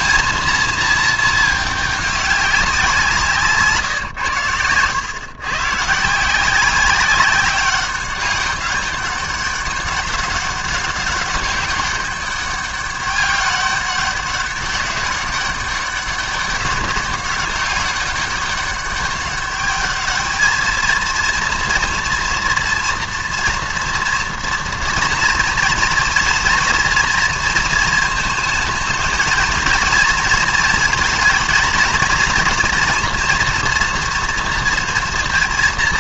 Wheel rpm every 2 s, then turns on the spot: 230, 190, 110, 180, 200, 200, 200, 190, 200, 200, 220, 240, 230, 230, 220, 230, 230, 230.
4-6